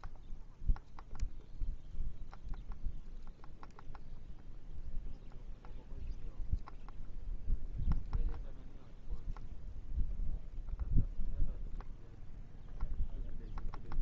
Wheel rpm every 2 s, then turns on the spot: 0, 0, 0, 0, 0, 0, 0.
none